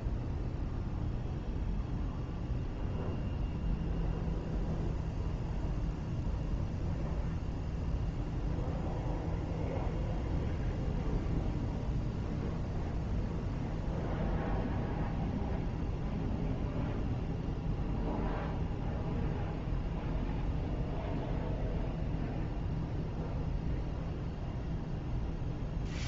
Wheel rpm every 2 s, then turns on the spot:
0, 0, 0, 0, 0, 0, 0, 0, 0, 0, 0, 0, 0.
none